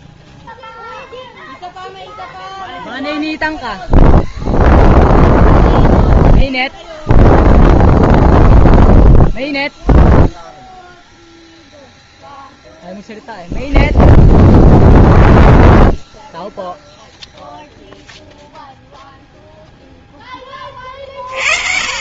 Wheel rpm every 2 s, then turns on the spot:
0, 0, 0, 0, 0, 0, 0, 0, 0, 0, 50.
none